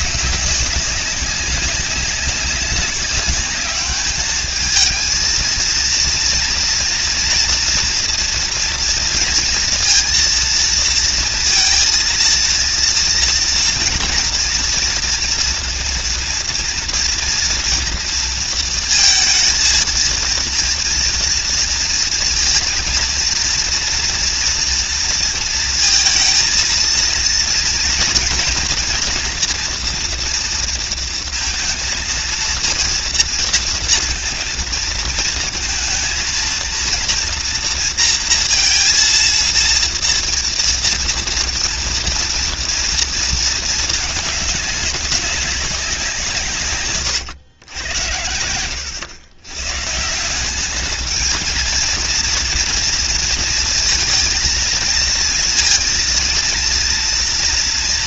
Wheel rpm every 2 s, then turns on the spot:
200, 190, 220, 230, 230, 230, 230, 230, 230, 230, 230, 230, 240, 230, 230, 230, 230, 230, 230, 230, 230, 230, 200, 130, 90, 200, 230, 230, 230.
48-50